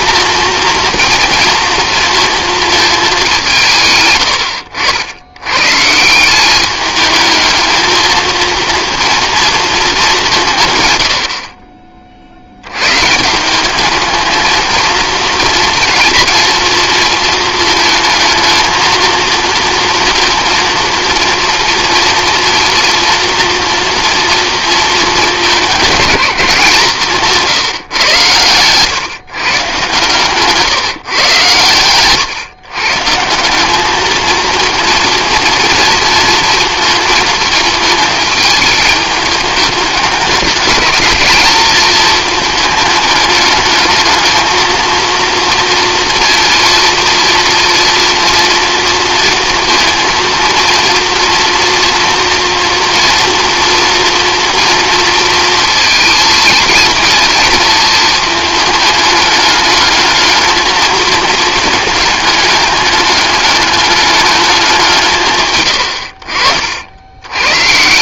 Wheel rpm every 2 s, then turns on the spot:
240, 230, 80, 200, 230, 120, 110, 230, 230, 230, 230, 230, 220, 170, 130, 150, 130, 230, 230, 210, 210, 220, 230, 230, 230, 230, 240, 230, 230, 210, 220, 210, 190, 60.
none